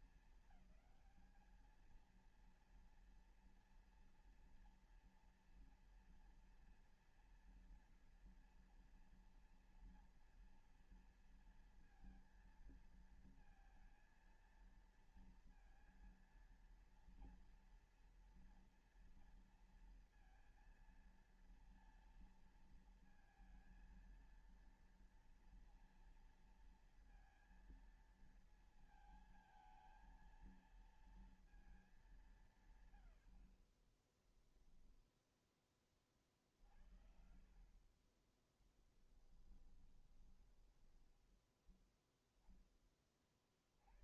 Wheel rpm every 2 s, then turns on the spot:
200, 230, 230, 230, 230, 230, 230, 230, 230, 230, 230, 230, 230, 230, 220, 220, 130, 0, 60, 20, 10, 20.
38-40